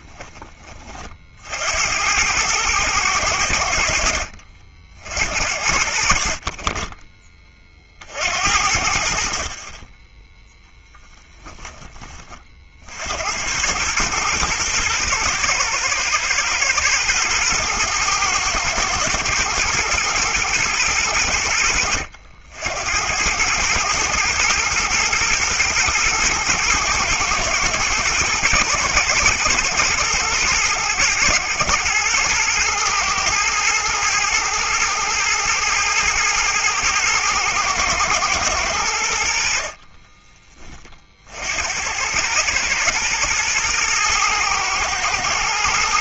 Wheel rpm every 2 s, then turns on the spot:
30, 110, 60, 30, 60, 10, 60, 110, 110, 110, 100, 80, 120, 110, 120, 110, 110, 120, 110, 100, 20, 110, 110.
10-12